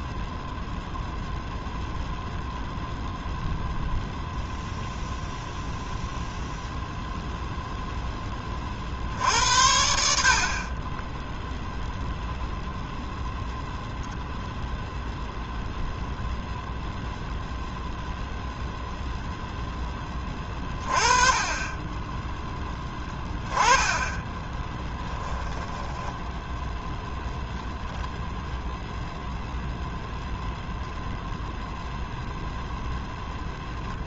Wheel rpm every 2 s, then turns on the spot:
0, 0, 0, 0, 60, 0, 0, 0, 0, 10, 20, 20, 10, 0, 0, 0, 0.
22-26